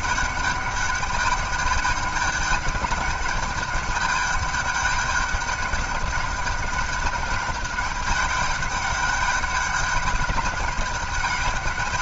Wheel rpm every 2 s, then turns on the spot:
200, 210, 200, 200, 200, 200.
none